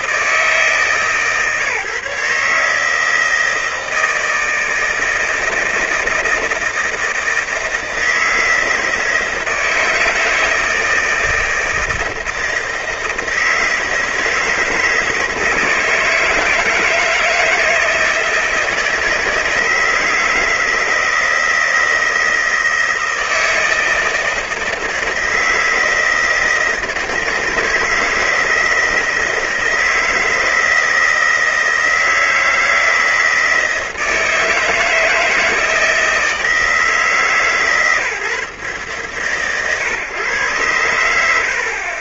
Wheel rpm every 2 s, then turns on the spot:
150, 160, 160, 160, 160, 160, 160, 160, 160, 160, 160, 160, 160, 160, 160, 160, 160, 160, 160, 140, 110.
none